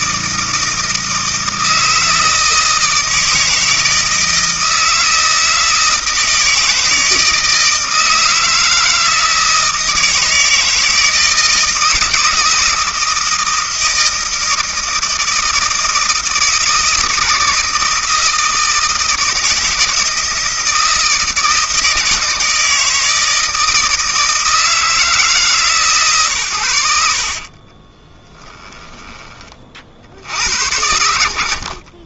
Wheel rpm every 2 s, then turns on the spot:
160, 160, 160, 160, 160, 160, 160, 160, 160, 160, 160, 160, 160, 110, 10, 70.
none